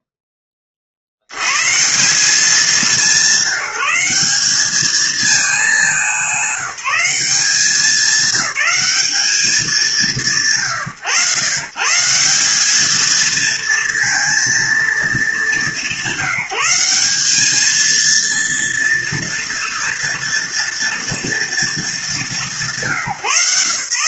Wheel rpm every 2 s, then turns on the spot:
70, 180, 220, 190, 190, 120, 220, 190, 200, 230, 220, 160.
none